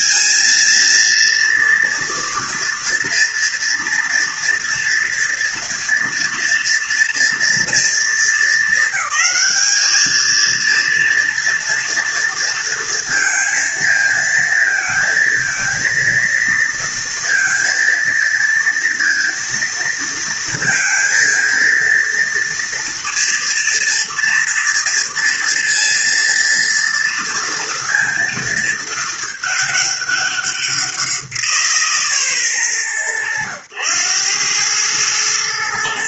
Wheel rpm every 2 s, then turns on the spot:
230, 230, 230, 230, 220, 220, 230, 230, 230, 230, 230, 230, 230, 230, 220, 190, 120, 100.
none